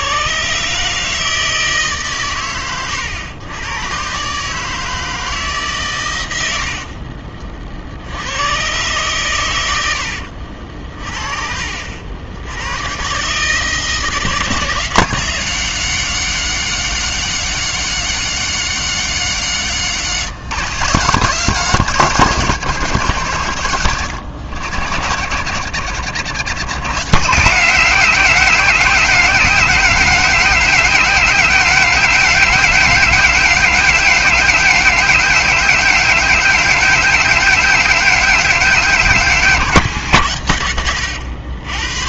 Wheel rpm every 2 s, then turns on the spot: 140, 110, 150, 80, 100, 60, 100, 170, 190, 190, 170, 180, 100, 130, 190, 190, 190, 190, 190, 190, 110.
10-12